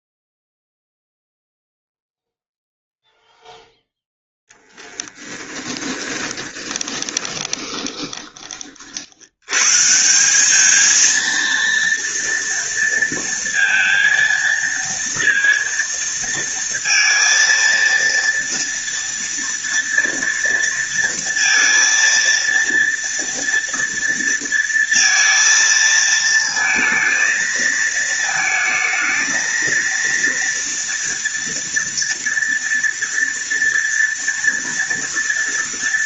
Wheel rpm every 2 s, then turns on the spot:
0, 0, 0, 10, 50, 220, 230, 230, 230, 230, 230, 230, 230, 230, 220, 230, 230, 230.
6-8